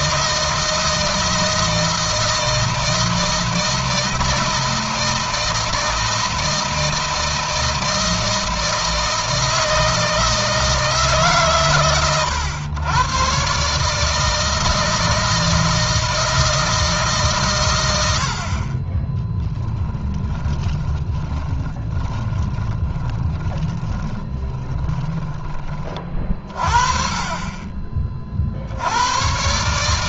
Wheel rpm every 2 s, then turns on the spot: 160, 160, 160, 160, 160, 150, 110, 160, 160, 20, 20, 20, 10, 40, 90.
18-26